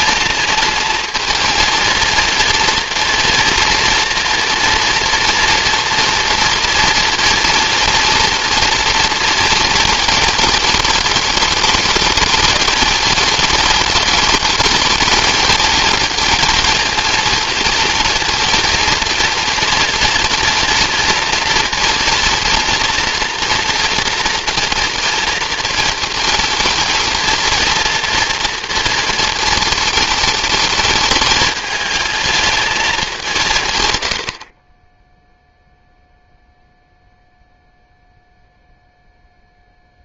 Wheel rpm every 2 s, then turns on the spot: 230, 230, 230, 230, 230, 220, 220, 220, 230, 230, 230, 230, 230, 220, 230, 220, 210, 20, 0, 0.
none